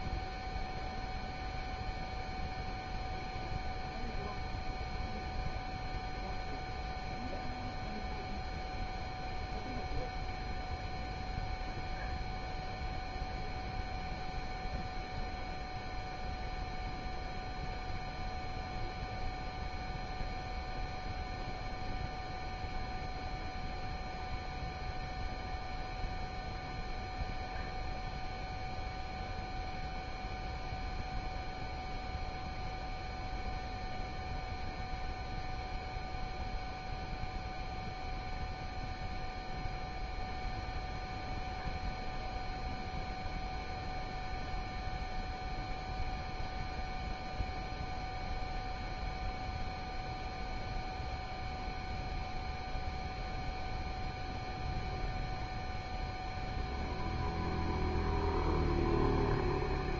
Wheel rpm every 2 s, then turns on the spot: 0, 0, 0, 0, 0, 0, 0, 0, 0, 0, 0, 0, 0, 0, 0, 0, 0, 0, 0, 0, 0, 0, 0, 0, 0, 0, 0, 0, 0, 0.
none